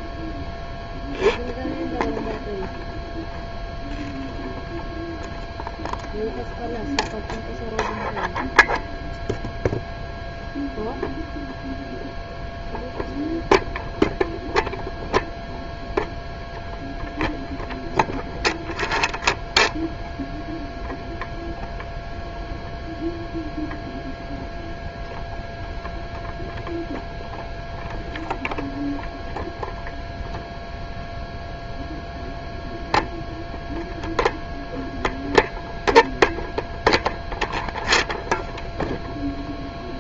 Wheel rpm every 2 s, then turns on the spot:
0, 0, 0, 0, 0, 0, 0, 0, 0, 0, 0, 0, 0, 0, 0, 0, 0, 0, 0, 0.
none